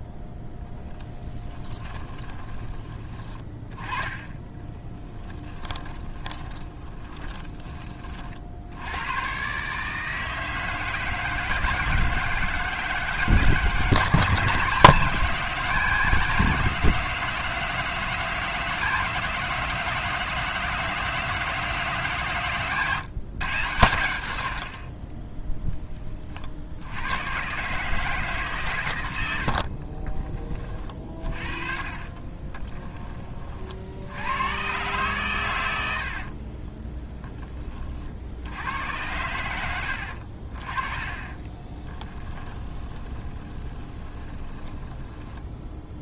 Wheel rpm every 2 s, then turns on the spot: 10, 20, 10, 20, 100, 160, 160, 160, 180, 180, 180, 140, 50, 70, 120, 20, 10, 110, 20, 90, 40, 20, 20.
0-2 4-8 22-24 32-34 36-38 42-46